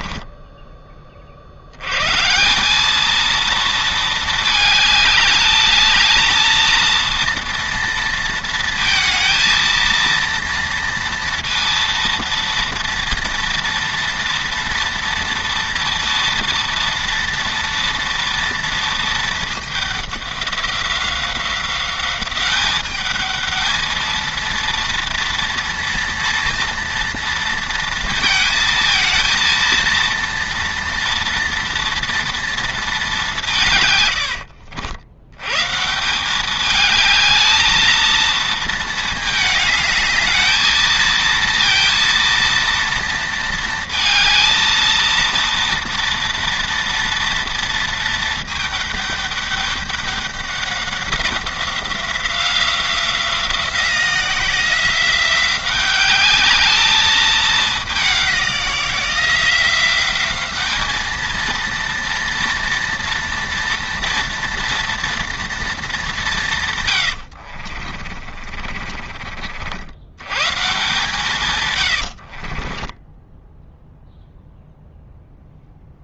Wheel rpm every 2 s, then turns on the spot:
20, 190, 220, 230, 220, 230, 230, 230, 230, 230, 190, 200, 230, 230, 230, 230, 230, 80, 210, 220, 220, 230, 230, 230, 220, 190, 180, 180, 210, 180, 210, 230, 240, 140, 40, 140, 30, 0.
0-2 68-70 72-74